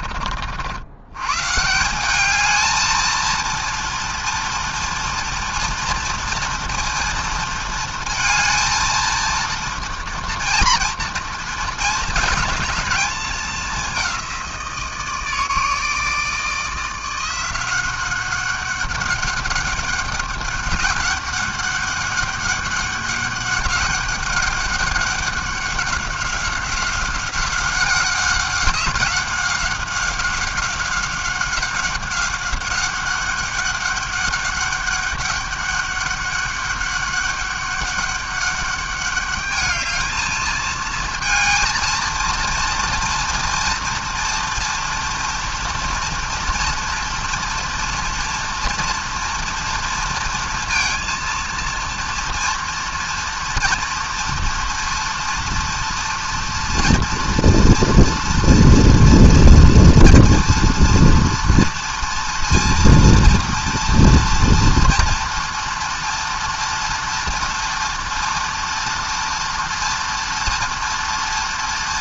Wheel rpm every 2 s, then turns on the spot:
30, 180, 230, 230, 220, 230, 220, 200, 160, 190, 200, 200, 200, 190, 190, 190, 190, 200, 200, 200, 220, 230, 230, 230, 230, 230, 230, 230, 230, 230, 230, 230, 230, 230, 230, 230.
none